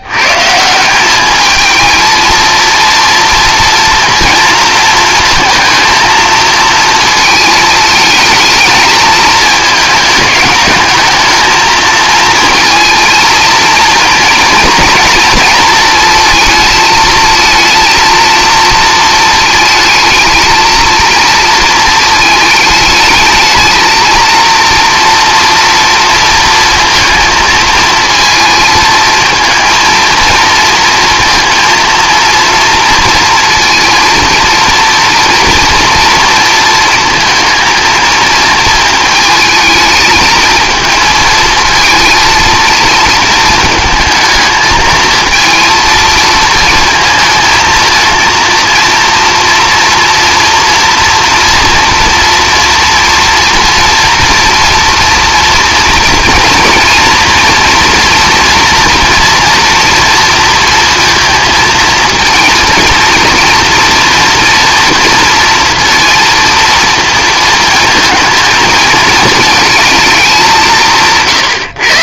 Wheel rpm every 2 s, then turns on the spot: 170, 230, 230, 230, 220, 210, 230, 230, 220, 230, 220, 220, 230, 230, 220, 230, 230, 230, 230, 230, 220, 230, 220, 230, 230, 240, 240, 230, 240, 240, 230, 230, 240, 230, 220, 170.
none